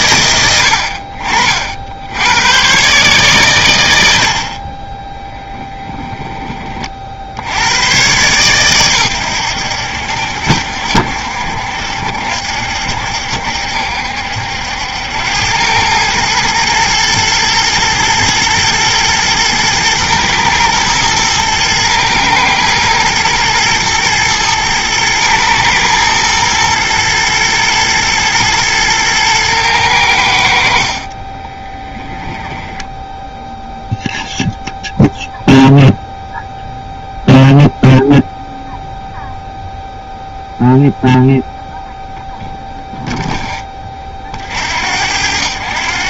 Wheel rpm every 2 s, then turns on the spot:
70, 130, 20, 40, 120, 60, 70, 80, 120, 110, 110, 110, 110, 120, 110, 50, 10, 0, 0, 0, 0, 0, 70.
30-34